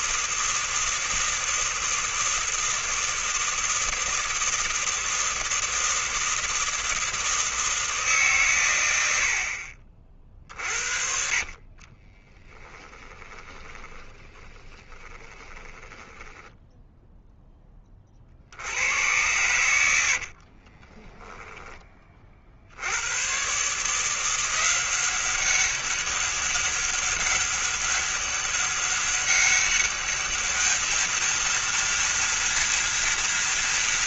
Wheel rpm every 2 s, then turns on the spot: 160, 160, 160, 160, 100, 60, 20, 20, 10, 90, 20, 80, 180, 200, 190, 220, 230.
10-18 20-22